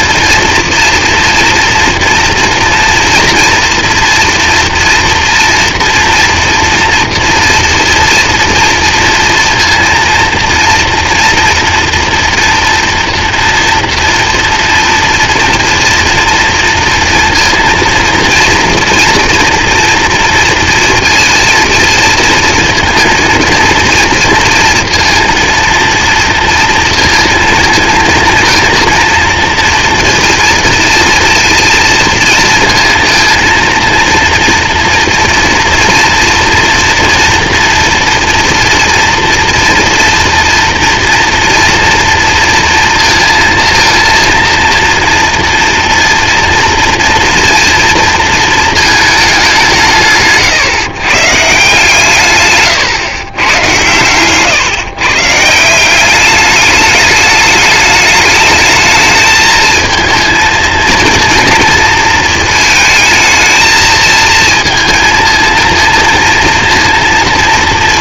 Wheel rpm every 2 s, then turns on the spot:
230, 230, 230, 230, 230, 240, 230, 230, 230, 230, 230, 230, 230, 230, 230, 230, 230, 230, 230, 240, 230, 230, 230, 240, 230, 140, 130, 130, 200, 220, 230, 220, 230, 230.
none